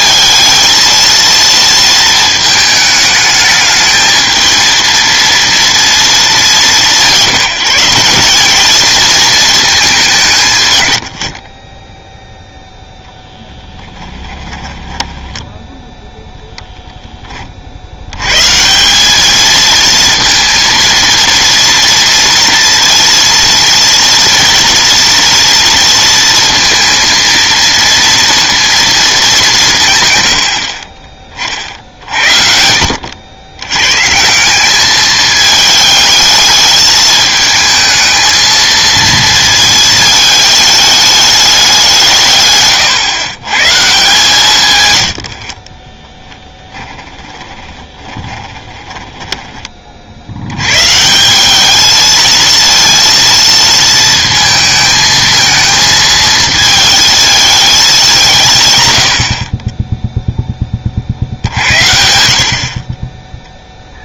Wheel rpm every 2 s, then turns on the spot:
230, 220, 220, 190, 210, 120, 0, 10, 0, 150, 230, 230, 230, 230, 230, 50, 70, 200, 210, 230, 210, 130, 130, 10, 20, 120, 230, 220, 220, 140, 20, 40.
14-16 46-50